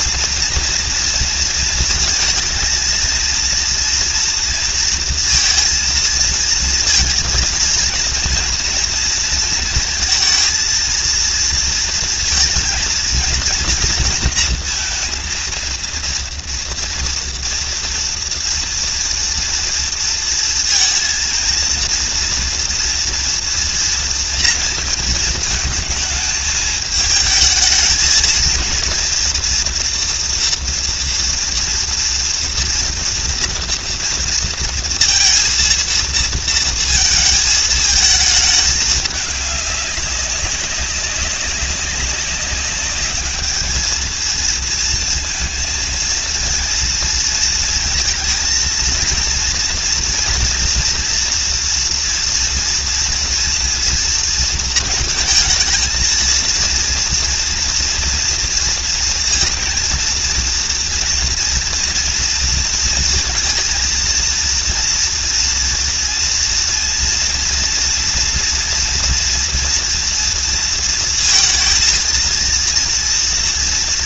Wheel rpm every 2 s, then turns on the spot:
230, 230, 230, 230, 230, 230, 230, 230, 230, 230, 230, 240, 230, 220, 230, 230, 230, 230, 230, 210, 190, 200, 230, 230, 230, 240, 230, 220, 230, 230, 230, 230, 230, 230, 230, 230, 230.
none